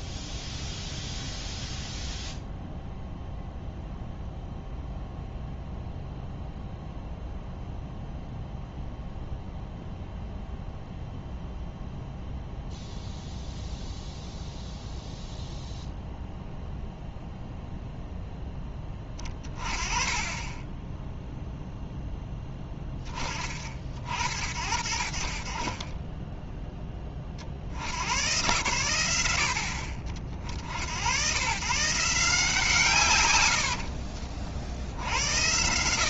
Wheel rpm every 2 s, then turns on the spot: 0, 0, 0, 0, 0, 0, 0, 0, 0, 10, 10, 10, 60, 10, 120, 60, 150, 60.
none